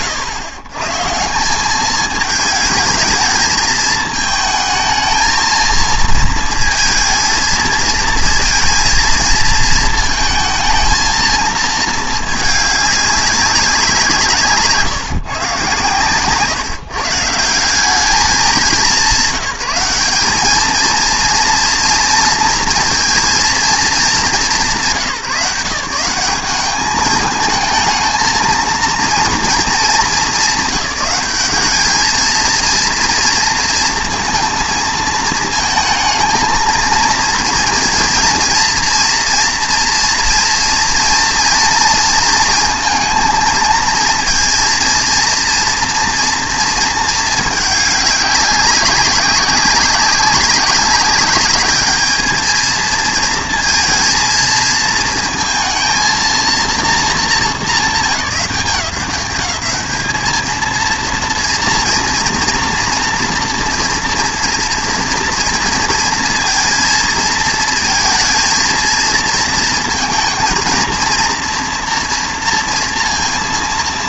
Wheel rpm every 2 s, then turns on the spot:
110, 220, 220, 230, 230, 230, 200, 140, 130, 180, 220, 230, 160, 200, 230, 190, 230, 230, 230, 230, 230, 230, 230, 230, 200, 200, 230, 220, 230, 180, 230, 230, 230, 230, 230, 230, 230.
none